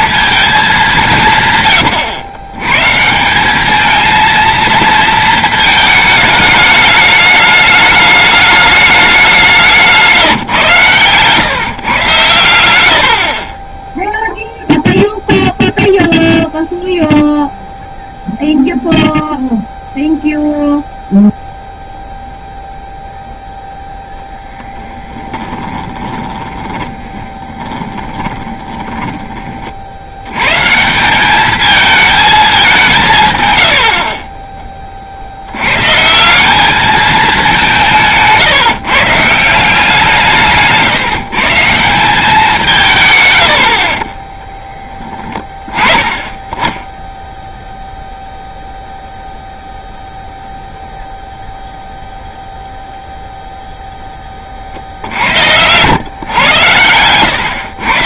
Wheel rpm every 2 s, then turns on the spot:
220, 110, 230, 220, 210, 140, 100, 0, 0, 0, 0, 0, 10, 20, 20, 120, 220, 20, 200, 140, 150, 170, 10, 10, 0, 0, 0, 40, 110.
24-30